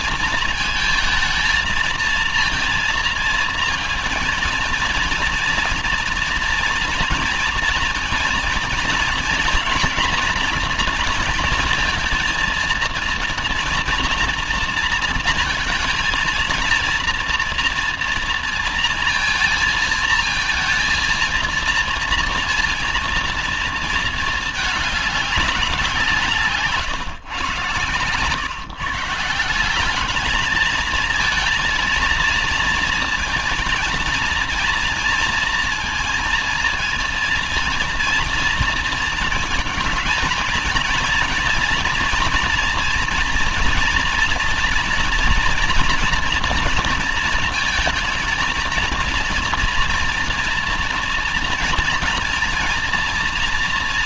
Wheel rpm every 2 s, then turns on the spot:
230, 230, 230, 230, 230, 230, 230, 220, 230, 230, 230, 230, 210, 160, 150, 220, 230, 230, 230, 230, 230, 230, 230, 230, 230, 240, 230.
none